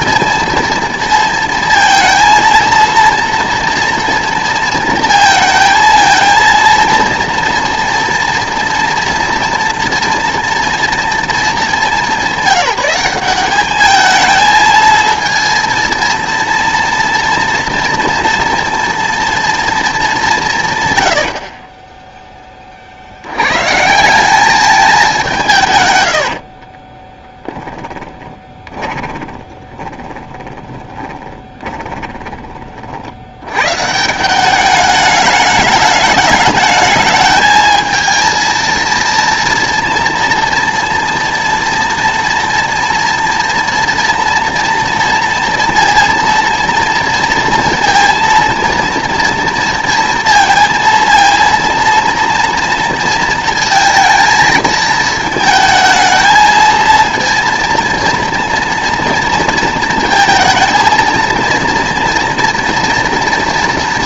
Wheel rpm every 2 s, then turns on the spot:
230, 230, 230, 230, 240, 230, 200, 220, 230, 230, 140, 20, 210, 50, 20, 10, 30, 190, 210, 220, 230, 230, 230, 230, 230, 230, 230, 220, 220, 230, 220, 230.
26-32